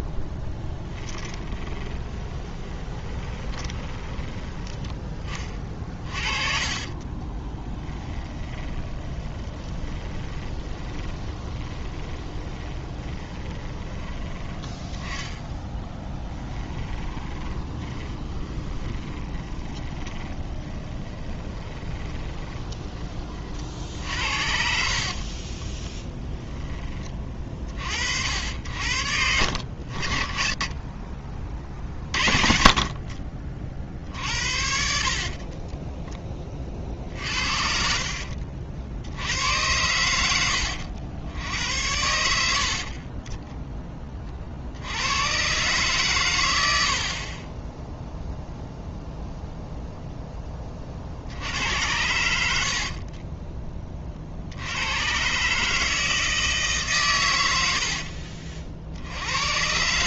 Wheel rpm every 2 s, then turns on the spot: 10, 20, 20, 40, 20, 20, 20, 20, 20, 20, 20, 20, 60, 20, 70, 80, 40, 60, 20, 60, 90, 70, 60, 140, 0, 20, 70, 90, 150, 40.
2-22 24-26 38-40 52-54